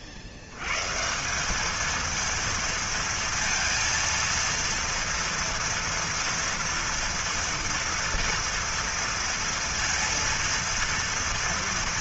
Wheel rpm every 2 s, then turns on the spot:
90, 230, 230, 230, 230, 230.
none